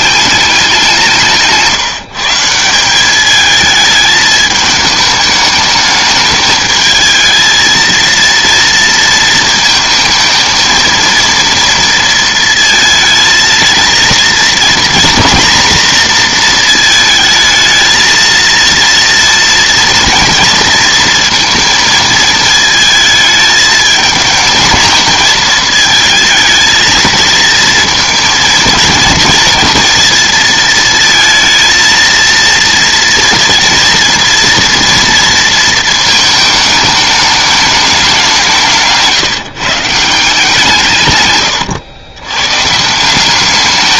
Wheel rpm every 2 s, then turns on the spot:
190, 170, 210, 220, 230, 220, 230, 230, 230, 230, 230, 220, 220, 220, 230, 230, 230, 230, 220, 160, 160, 130.
none